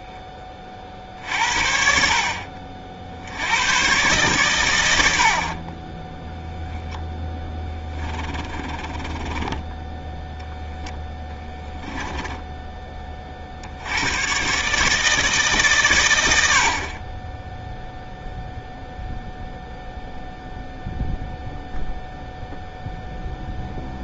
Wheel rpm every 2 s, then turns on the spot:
40, 50, 110, 0, 20, 0, 20, 150, 50, 0, 0, 0.
8-10